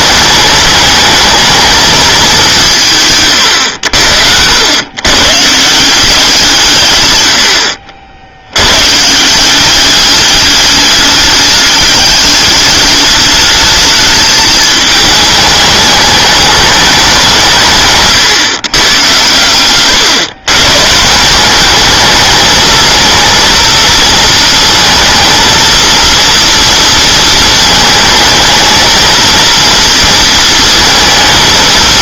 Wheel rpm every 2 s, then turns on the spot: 220, 160, 100, 130, 120, 200, 210, 220, 200, 130, 130, 220, 230, 230, 220, 220.
none